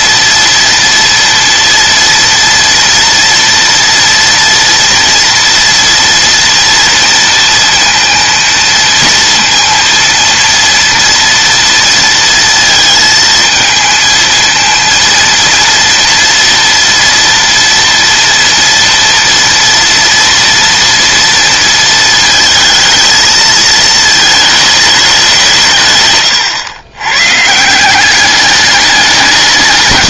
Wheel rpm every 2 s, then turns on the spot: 230, 230, 240, 230, 230, 230, 230, 230, 230, 230, 230, 230, 210, 110, 200.
none